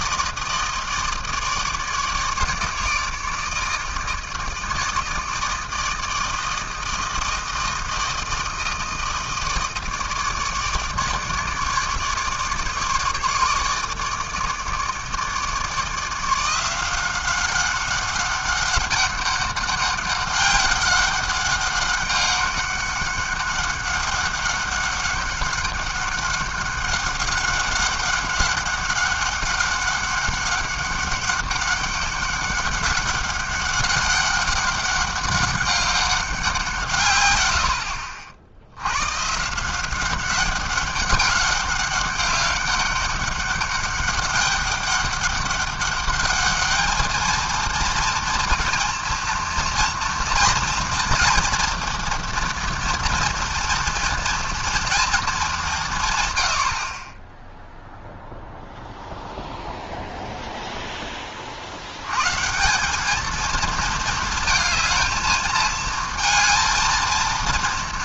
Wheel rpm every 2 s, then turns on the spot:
160, 150, 160, 160, 160, 150, 150, 150, 170, 190, 200, 200, 190, 200, 200, 190, 200, 200, 160, 80, 200, 200, 200, 210, 230, 230, 240, 230, 70, 0, 0, 180, 220, 230.
none